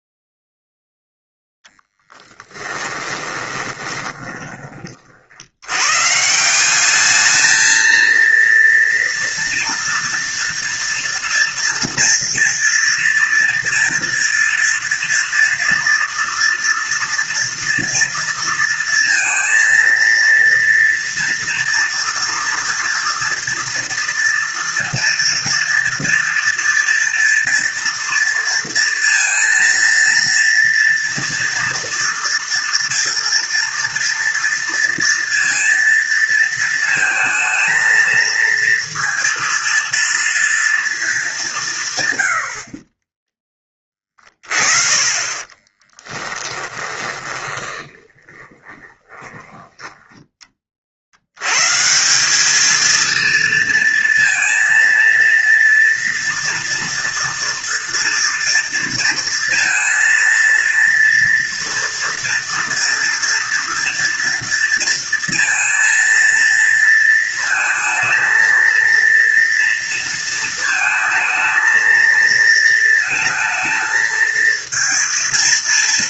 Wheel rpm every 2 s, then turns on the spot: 0, 10, 30, 180, 230, 230, 230, 240, 230, 230, 230, 230, 230, 230, 230, 230, 240, 230, 220, 230, 230, 40, 20, 20, 20, 40, 220, 230, 230, 230, 230, 230, 230, 230, 230, 220, 230, 220.
2-4 46-50